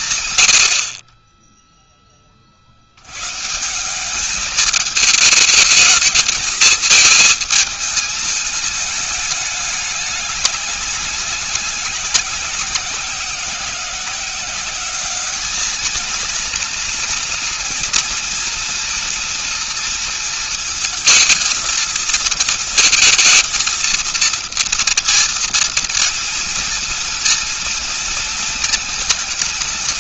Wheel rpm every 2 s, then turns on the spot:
50, 80, 210, 220, 210, 190, 180, 200, 230, 230, 220, 230, 230, 230, 220.
none